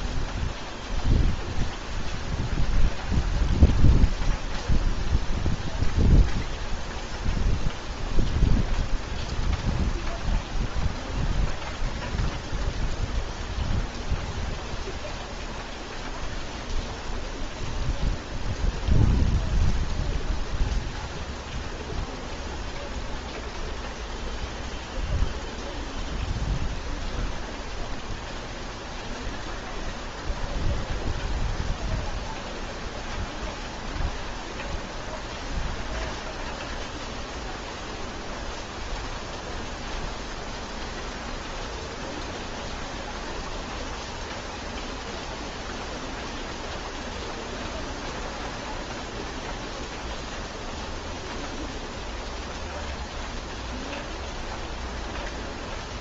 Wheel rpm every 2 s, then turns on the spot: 0, 0, 0, 0, 0, 0, 0, 0, 0, 0, 0, 0, 0, 0, 0, 0, 0, 0, 0, 0, 0, 0, 0, 0, 0, 0, 0, 0.
none